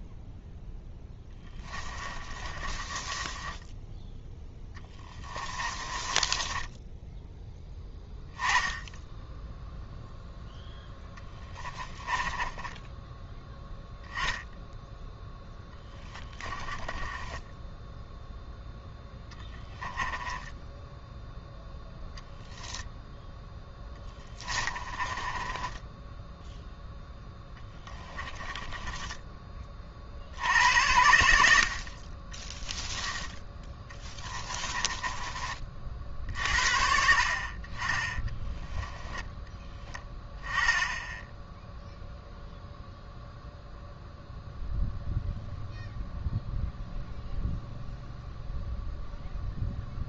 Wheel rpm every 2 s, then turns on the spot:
10, 20, 20, 10, 10, 10, 10, 0, 10, 0, 10, 0, 20, 0, 20, 110, 10, 20, 60, 10, 10, 0, 0, 0, 0.
0-8 10-14 16-18 24-26 28-30 34-36 38-40